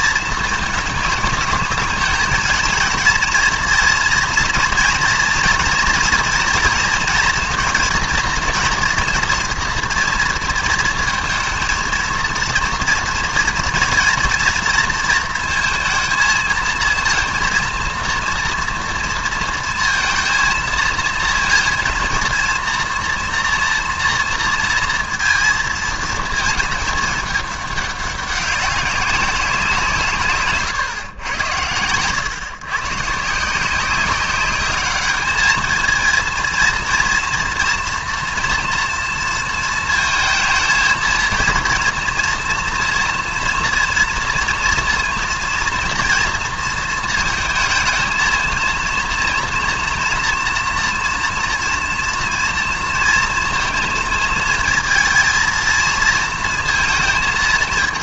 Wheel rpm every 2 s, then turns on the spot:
220, 230, 230, 230, 230, 230, 230, 230, 230, 230, 230, 230, 230, 220, 190, 140, 130, 200, 230, 230, 230, 230, 230, 230, 230, 240, 230, 220, 230.
30-32